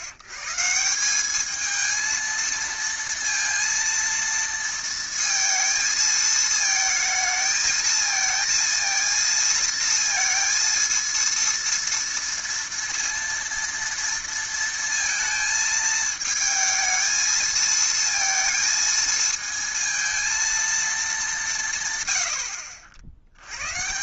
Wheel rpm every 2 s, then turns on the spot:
130, 230, 230, 220, 230, 230, 230, 230, 220, 230, 230, 80.
none